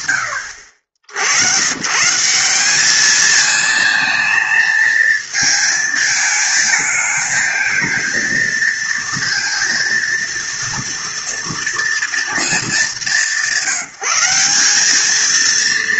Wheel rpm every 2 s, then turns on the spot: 70, 220, 220, 220, 230, 230, 190, 220.
none